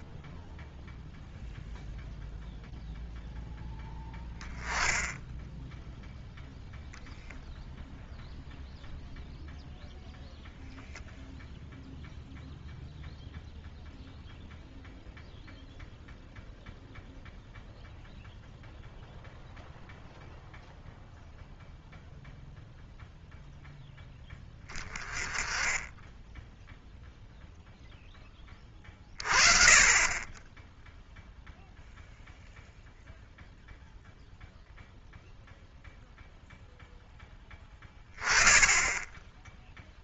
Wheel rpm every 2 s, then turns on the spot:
0, 0, 10, 0, 0, 0, 0, 0, 0, 0, 0, 0, 10, 0, 30, 0, 0, 0, 0, 10.
none